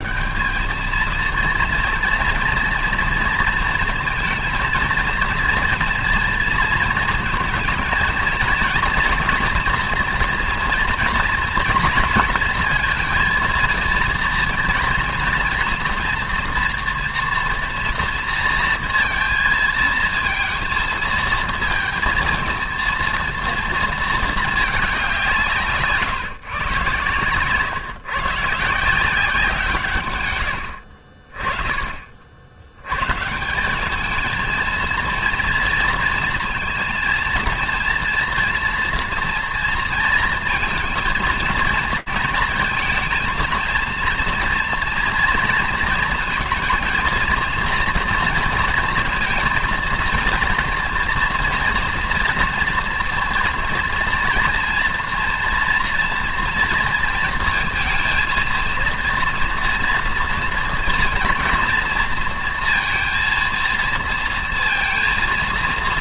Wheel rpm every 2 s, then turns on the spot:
230, 230, 230, 230, 230, 230, 230, 230, 230, 230, 230, 230, 190, 120, 170, 50, 120, 230, 230, 230, 230, 220, 230, 230, 230, 240, 230, 240, 230, 230, 230, 230, 230.
none